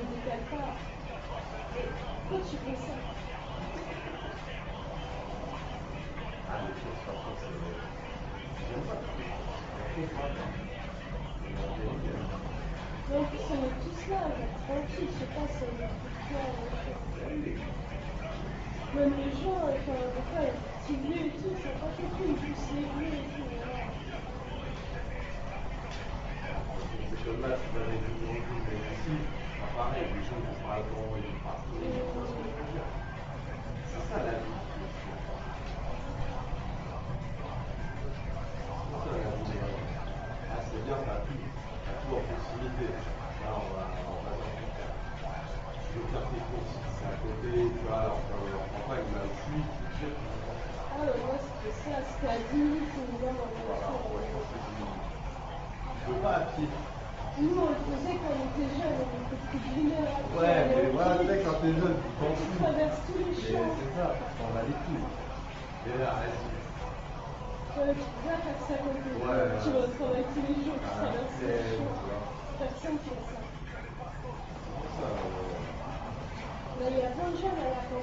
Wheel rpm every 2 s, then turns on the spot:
0, 0, 0, 0, 0, 0, 0, 0, 0, 0, 0, 0, 0, 0, 0, 0, 0, 0, 0, 0, 0, 0, 0, 0, 0, 0, 0, 0, 0, 0, 0, 0, 0, 0, 0, 0, 0, 0, 0.
none